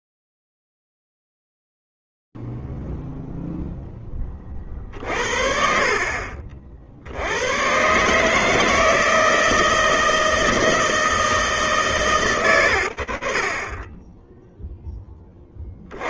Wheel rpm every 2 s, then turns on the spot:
0, 0, 0, 50, 120, 160, 160, 20.
none